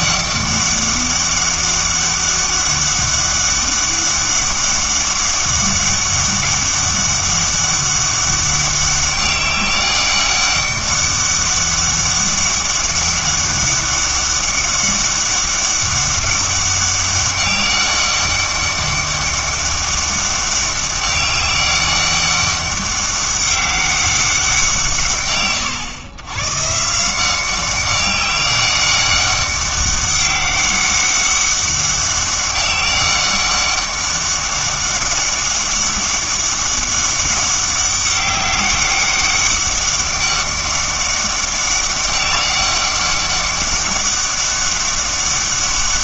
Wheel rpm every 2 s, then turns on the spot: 200, 200, 200, 200, 200, 200, 200, 200, 200, 200, 200, 200, 130, 150, 200, 200, 200, 200, 200, 200, 200, 200, 200.
none